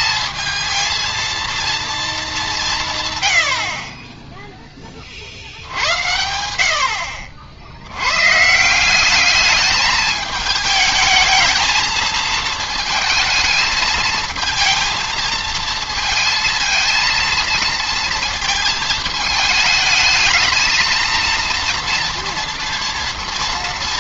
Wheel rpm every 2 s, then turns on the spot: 230, 180, 10, 80, 160, 220, 220, 220, 220, 220, 220, 230.
none